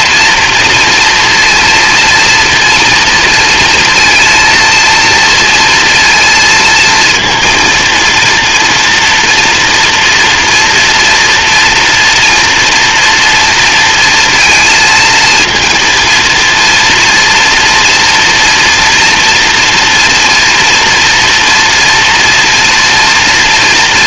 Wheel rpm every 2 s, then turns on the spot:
230, 230, 230, 230, 230, 240, 230, 230, 230, 230, 230, 230.
none